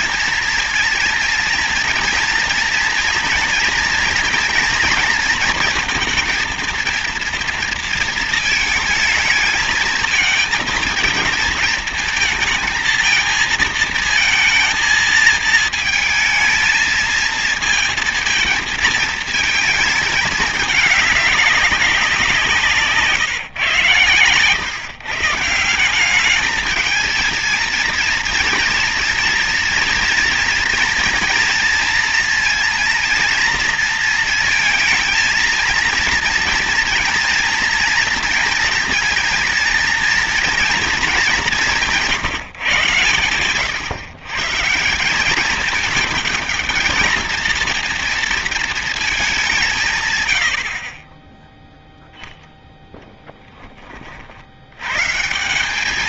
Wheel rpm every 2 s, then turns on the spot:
230, 230, 230, 230, 230, 230, 230, 220, 220, 230, 200, 160, 130, 220, 230, 230, 230, 230, 230, 220, 220, 130, 150, 220, 220, 60, 10, 100.
none